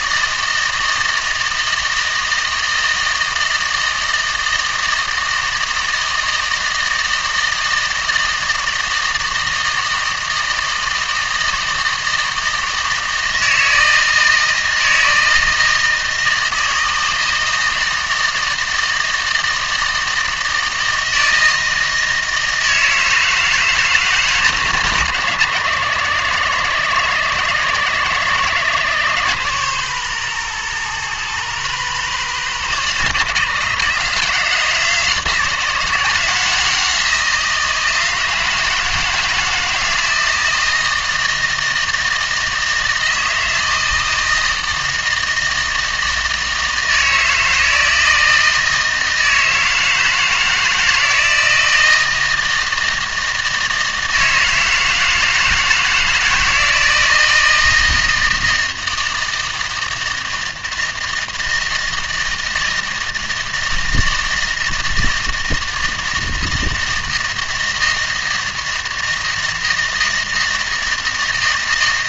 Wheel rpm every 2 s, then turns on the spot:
160, 160, 160, 160, 160, 160, 160, 160, 160, 160, 160, 160, 120, 80, 90, 120, 100, 130, 160, 160, 160, 160, 160, 160, 160, 160, 160, 160, 160, 160, 160, 160, 160, 160, 160, 160.
none